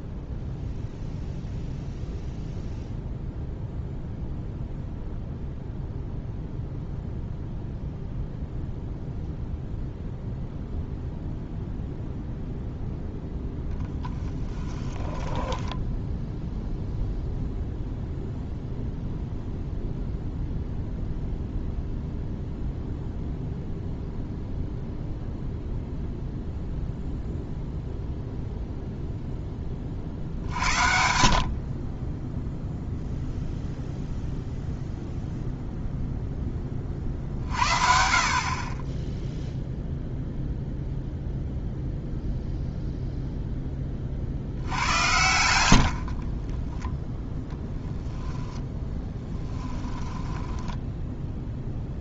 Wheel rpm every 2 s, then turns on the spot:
0, 0, 0, 0, 0, 0, 0, 30, 0, 0, 0, 0, 0, 0, 0, 70, 0, 0, 30, 20, 0, 0, 80, 20, 0, 10.
14-16 46-48 50-52